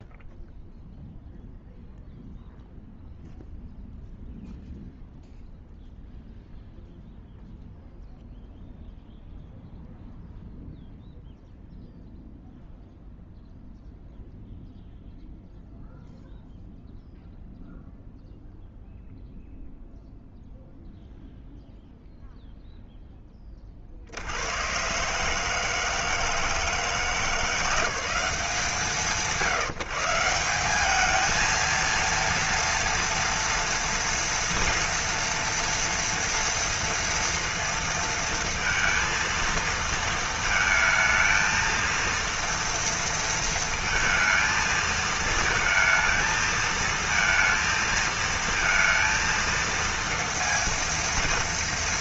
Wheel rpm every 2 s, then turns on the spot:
0, 0, 0, 0, 0, 0, 0, 0, 0, 0, 0, 0, 90, 160, 190, 180, 230, 230, 230, 230, 220, 230, 220, 220, 230, 230.
none